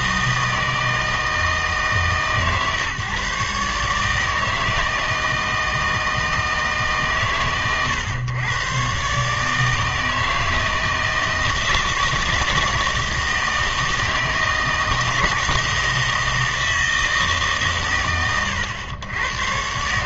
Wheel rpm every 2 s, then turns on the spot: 160, 140, 160, 150, 120, 160, 160, 160, 160, 100.
none